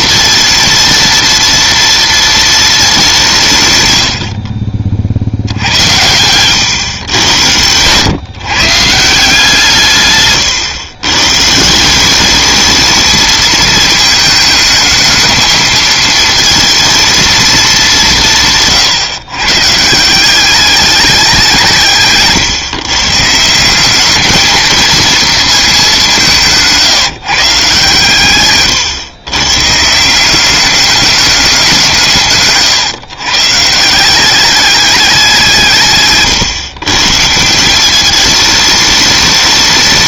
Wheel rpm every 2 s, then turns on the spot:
230, 220, 50, 120, 140, 120, 210, 220, 230, 140, 200, 130, 220, 170, 120, 190, 130, 200, 140, 210.
none